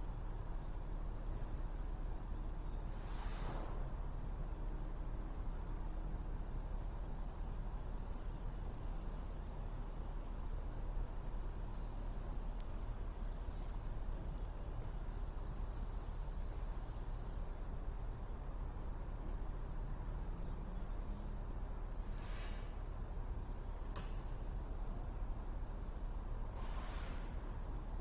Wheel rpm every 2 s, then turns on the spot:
0, 0, 0, 0, 0, 0, 0, 0, 0, 0, 0, 0, 0, 0.
none